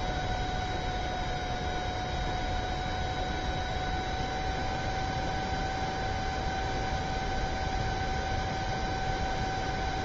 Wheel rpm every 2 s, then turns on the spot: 0, 0, 0, 0, 0.
none